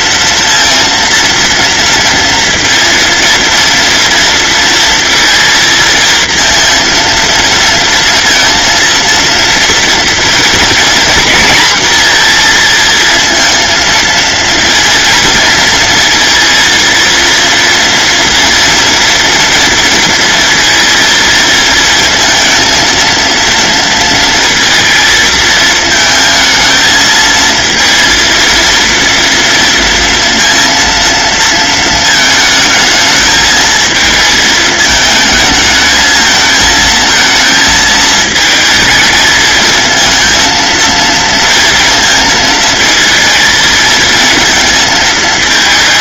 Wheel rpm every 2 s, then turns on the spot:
230, 230, 230, 230, 230, 240, 230, 230, 230, 240, 230, 230, 230, 220, 230, 230, 220, 220, 220, 220, 230, 220, 230.
none